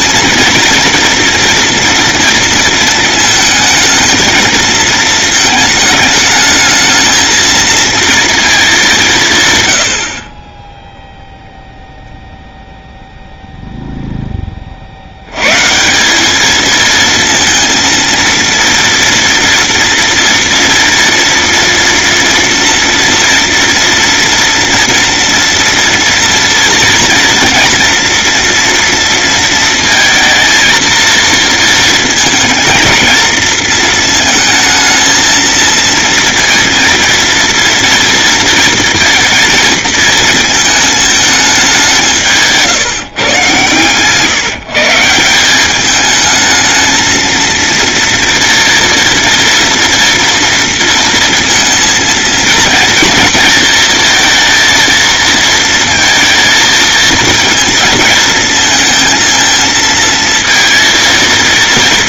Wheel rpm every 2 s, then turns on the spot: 230, 230, 220, 220, 50, 0, 0, 150, 230, 230, 230, 230, 230, 230, 230, 230, 230, 230, 230, 220, 200, 140, 210, 230, 230, 230, 230, 230, 220, 230, 230.
none